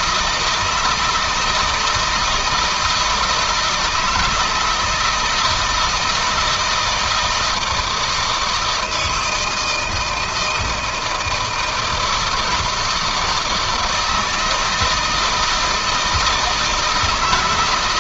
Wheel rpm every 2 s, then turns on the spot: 160, 160, 160, 160, 160, 160, 160, 160, 170.
none